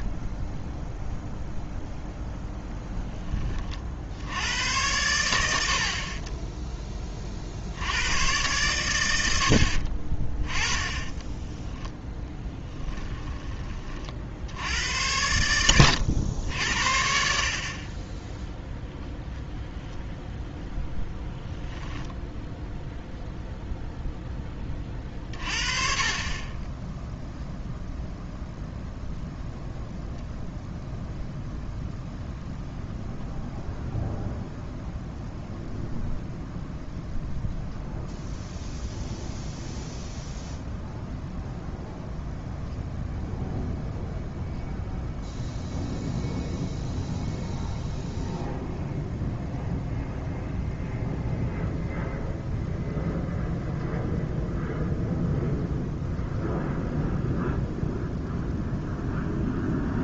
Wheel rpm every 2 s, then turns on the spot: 0, 0, 90, 10, 100, 20, 10, 80, 70, 0, 0, 0, 20, 10, 0, 0, 0, 0, 0, 0, 0, 0, 0, 0, 0, 0, 0, 0, 0, 0.
10-14